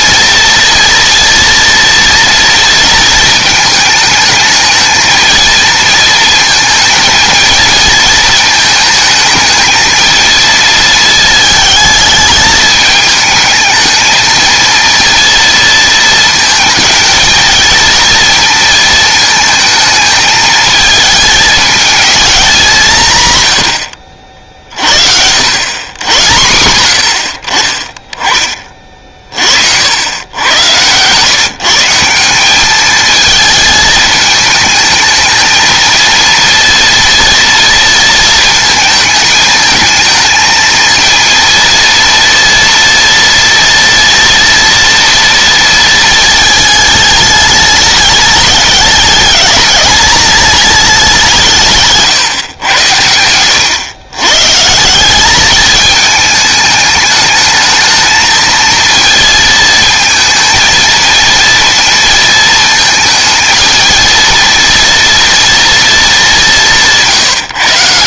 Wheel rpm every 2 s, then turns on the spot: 240, 230, 220, 220, 220, 220, 210, 230, 220, 220, 220, 190, 50, 90, 30, 110, 200, 220, 230, 230, 230, 230, 240, 220, 210, 210, 120, 150, 220, 230, 230, 230, 230, 180.
52-54